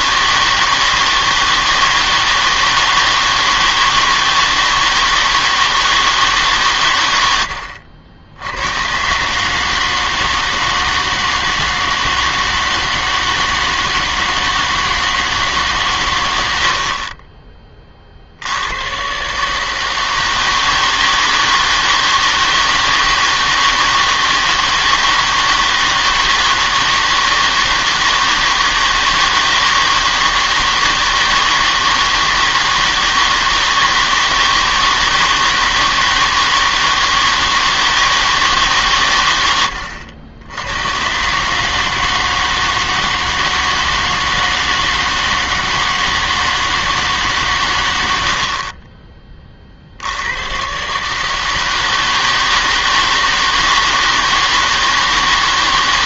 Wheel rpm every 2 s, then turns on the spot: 160, 160, 160, 130, 100, 160, 160, 160, 80, 100, 160, 160, 160, 160, 160, 160, 160, 160, 160, 150, 90, 160, 160, 160, 60, 120, 160, 160.
16-18 48-50